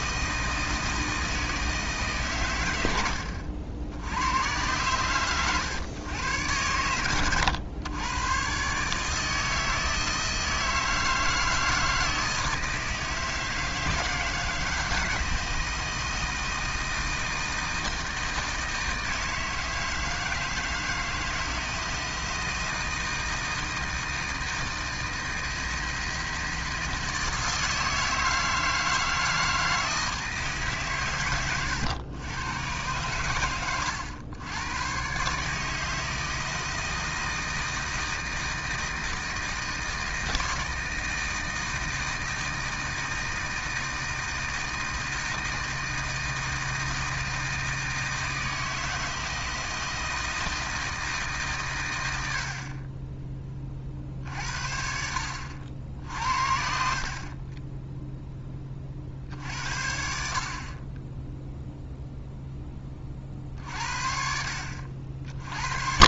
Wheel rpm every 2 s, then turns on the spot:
160, 90, 110, 100, 150, 160, 160, 160, 160, 160, 160, 160, 160, 160, 160, 130, 100, 120, 160, 160, 160, 160, 160, 160, 160, 160, 30, 60, 40, 40, 30, 30, 60.
56-58